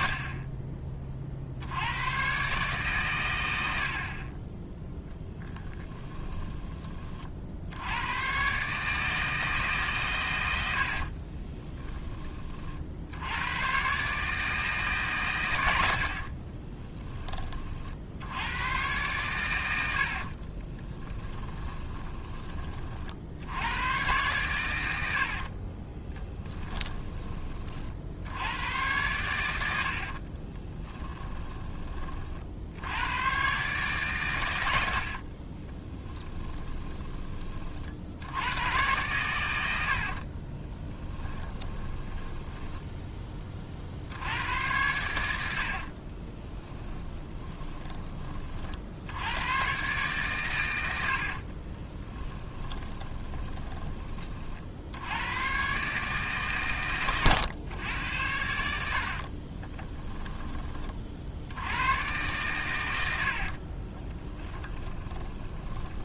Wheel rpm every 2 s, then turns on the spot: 30, 140, 10, 20, 150, 70, 60, 150, 20, 120, 20, 40, 100, 20, 100, 10, 90, 70, 10, 110, 20, 10, 100, 20, 60, 90, 20, 70, 120, 70, 40, 100, 10.
10-12 16-18 20-22 24-28 30-32 36-38 40-42 46-48 50-54 64-66